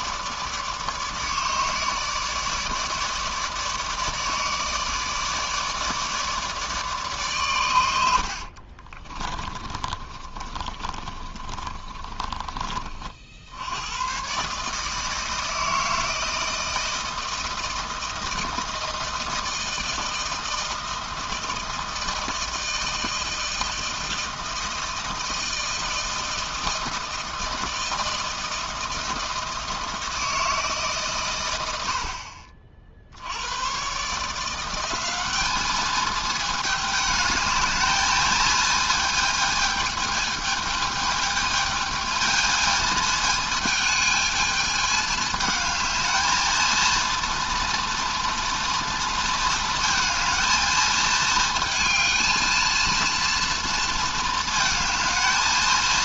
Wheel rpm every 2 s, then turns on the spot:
150, 150, 160, 150, 40, 30, 30, 150, 160, 160, 160, 160, 160, 160, 160, 150, 60, 180, 210, 220, 220, 220, 220, 230, 230, 220, 230, 230.
8-12